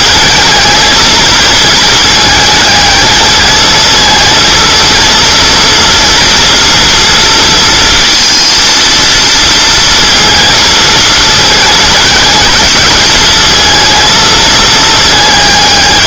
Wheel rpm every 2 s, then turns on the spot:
220, 220, 230, 230, 230, 230, 210, 220.
none